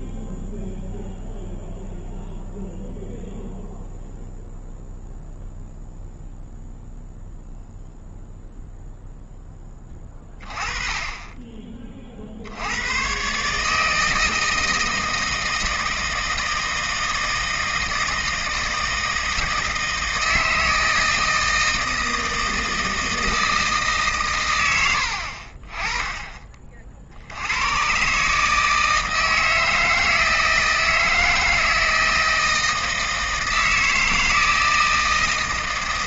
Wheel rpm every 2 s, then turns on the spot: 0, 0, 0, 0, 0, 20, 80, 160, 160, 160, 160, 160, 100, 30, 150, 160, 160, 160.
none